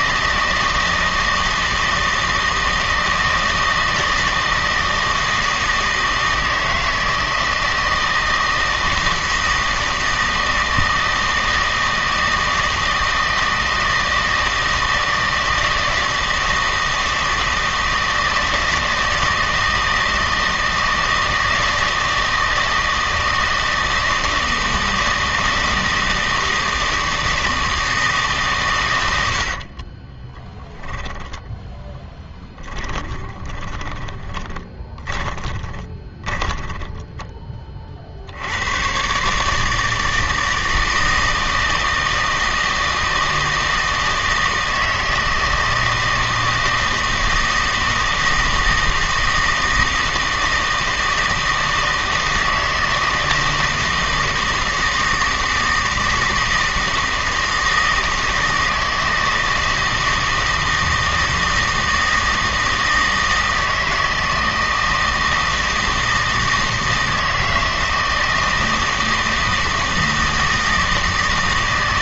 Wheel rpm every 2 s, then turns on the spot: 160, 160, 160, 160, 160, 160, 160, 160, 160, 160, 160, 160, 160, 160, 130, 10, 20, 20, 10, 90, 160, 160, 160, 160, 160, 160, 160, 160, 160, 160, 160, 160, 160, 160, 160, 160.
30-38